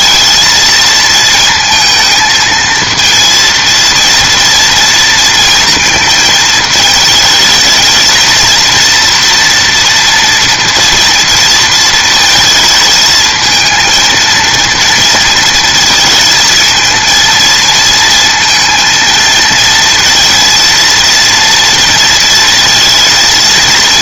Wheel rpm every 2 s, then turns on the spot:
230, 230, 230, 220, 230, 230, 220, 230, 230, 230, 230, 230.
none